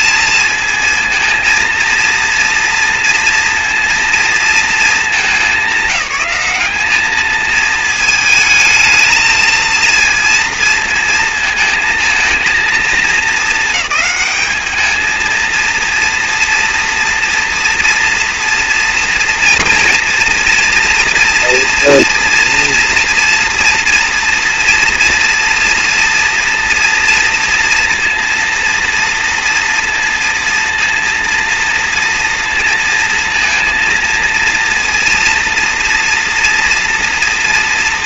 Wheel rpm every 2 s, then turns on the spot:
230, 230, 230, 200, 220, 230, 230, 210, 230, 230, 230, 240, 240, 230, 230, 230, 230, 230, 240.
none